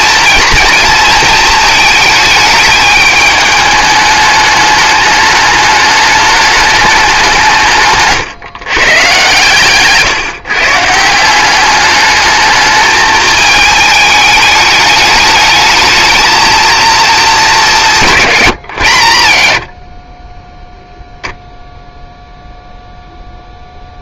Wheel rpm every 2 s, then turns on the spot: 230, 210, 210, 200, 130, 150, 210, 210, 230, 110, 0, 0.
none